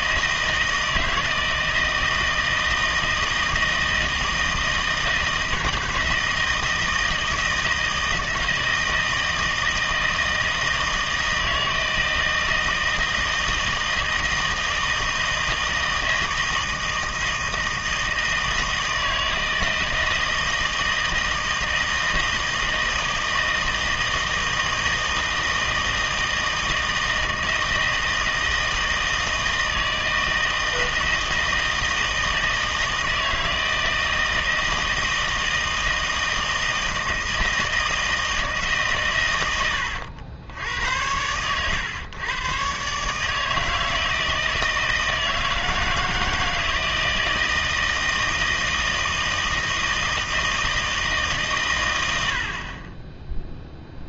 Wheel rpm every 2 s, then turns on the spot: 160, 160, 160, 160, 160, 160, 160, 160, 160, 160, 160, 160, 160, 160, 160, 160, 160, 160, 160, 160, 90, 120, 160, 160, 160, 160, 60.
none